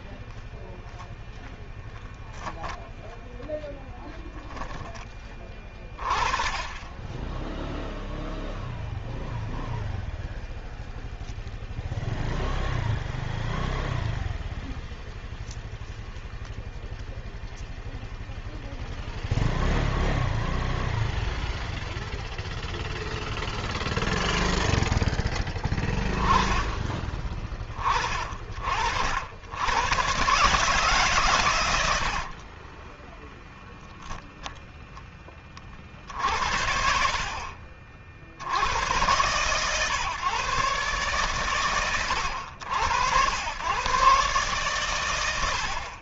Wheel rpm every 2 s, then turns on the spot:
0, 0, 10, 10, 0, 0, 0, 0, 0, 0, 0, 0, 0, 20, 60, 140, 10, 10, 70, 100, 130, 90, 110.
32-34